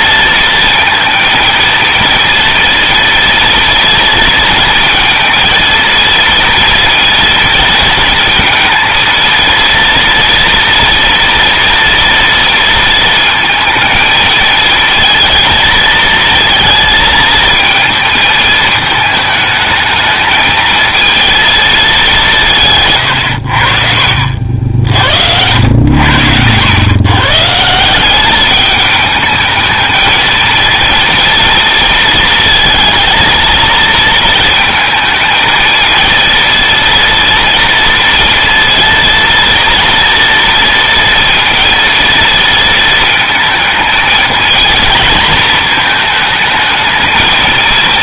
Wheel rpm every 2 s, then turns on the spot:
230, 230, 230, 230, 230, 230, 230, 220, 220, 220, 220, 150, 60, 110, 210, 230, 230, 230, 230, 230, 230, 230, 230, 220.
none